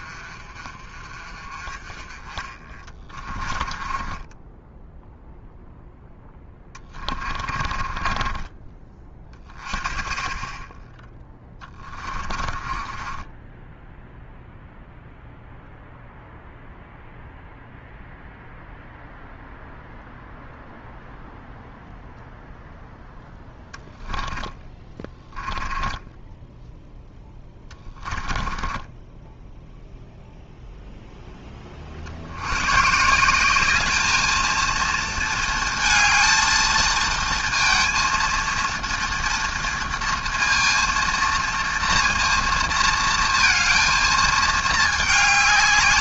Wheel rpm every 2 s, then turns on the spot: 40, 20, 10, 20, 20, 10, 20, 0, 0, 0, 0, 0, 10, 0, 20, 0, 120, 220, 220, 230, 230, 230, 220.
2-8 12-14 24-26 28-30